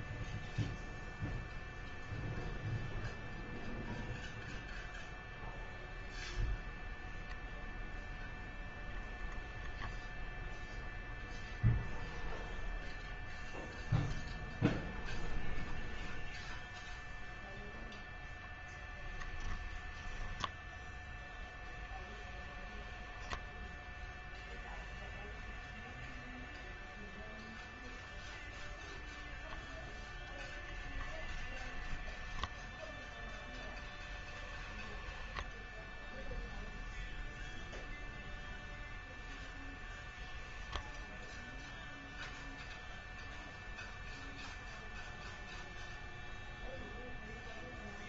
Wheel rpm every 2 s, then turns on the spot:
0, 0, 0, 0, 0, 0, 0, 0, 0, 10, 0, 10, 0, 0, 0, 0, 0, 10, 0, 0, 10, 0, 0, 0.
34-36